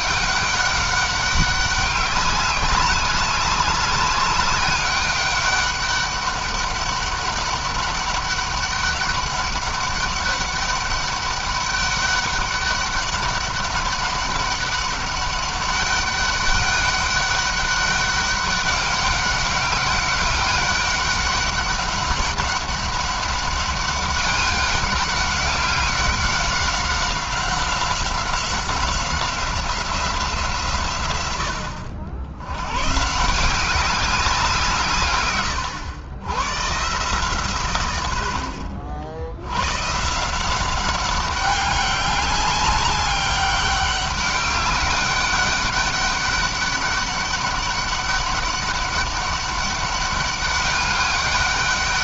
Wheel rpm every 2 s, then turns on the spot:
200, 200, 200, 200, 200, 200, 200, 200, 200, 200, 200, 200, 200, 190, 190, 130, 140, 140, 140, 70, 190, 200, 200, 200, 200, 200.
none